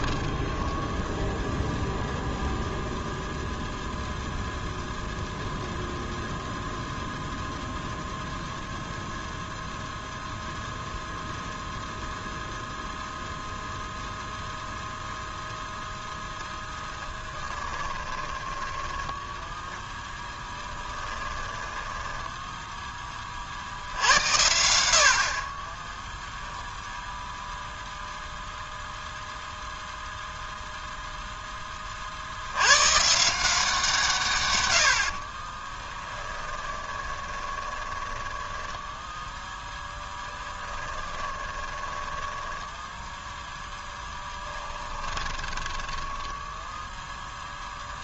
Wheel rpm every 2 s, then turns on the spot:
10, 0, 0, 0, 0, 0, 0, 0, 10, 10, 10, 10, 70, 0, 0, 0, 120, 90, 20, 10, 10, 10, 20, 0.
0-2 16-22 36-46